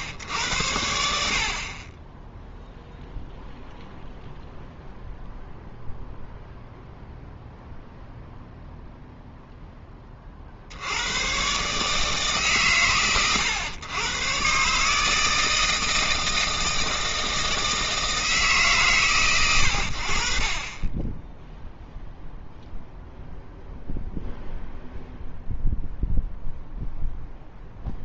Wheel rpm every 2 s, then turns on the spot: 80, 0, 0, 0, 0, 50, 140, 130, 160, 150, 40, 0, 0, 0.
none